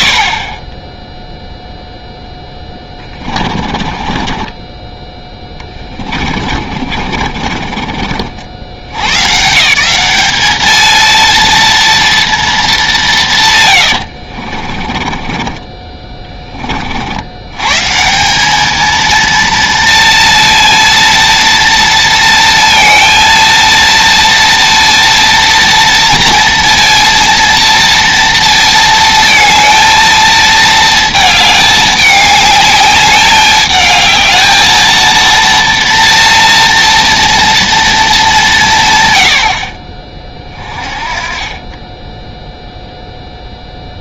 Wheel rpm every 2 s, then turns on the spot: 30, 10, 20, 40, 80, 220, 200, 30, 50, 210, 230, 230, 230, 230, 230, 220, 210, 220, 230, 140, 30, 0.
2-8 14-16